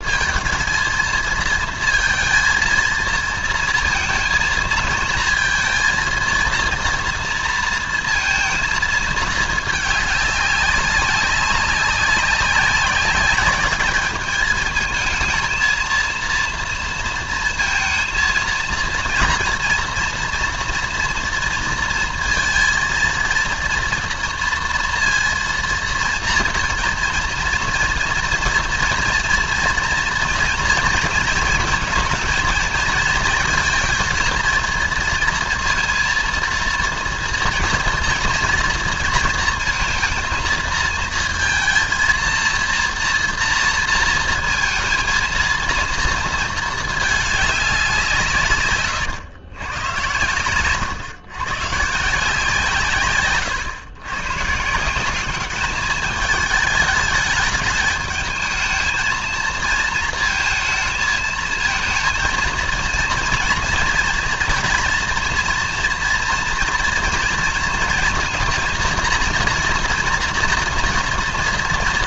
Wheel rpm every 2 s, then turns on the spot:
230, 230, 230, 230, 230, 200, 200, 220, 230, 230, 230, 230, 230, 230, 240, 230, 230, 230, 230, 230, 230, 230, 230, 220, 120, 120, 140, 160, 210, 220, 220, 230, 230, 240, 230, 230.
none